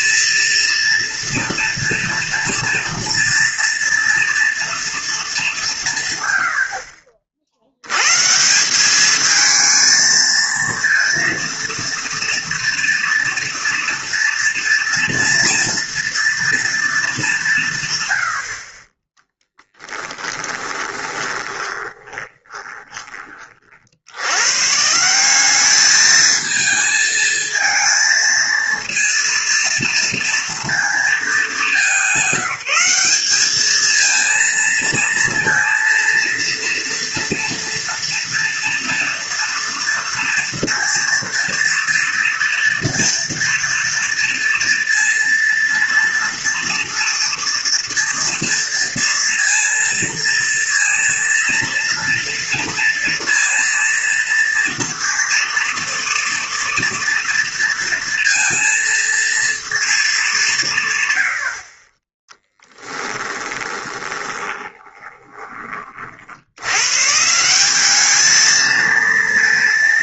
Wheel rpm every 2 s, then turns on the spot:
230, 240, 230, 70, 190, 230, 230, 240, 230, 30, 30, 20, 130, 220, 230, 230, 190, 230, 240, 230, 230, 230, 230, 230, 230, 230, 230, 230, 230, 230, 150, 10, 20, 110, 220.
20-24 62-66